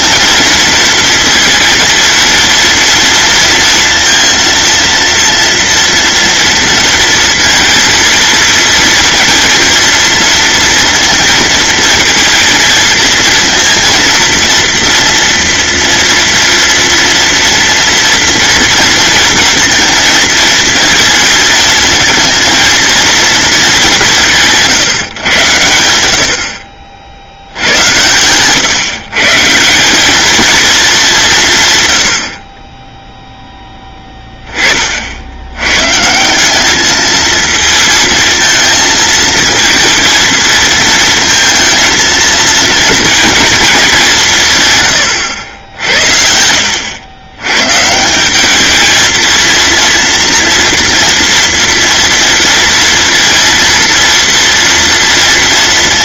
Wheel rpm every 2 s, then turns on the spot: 230, 230, 230, 230, 220, 230, 230, 230, 230, 230, 220, 220, 150, 50, 140, 210, 20, 40, 210, 230, 230, 230, 130, 80, 220, 230, 230, 230.
none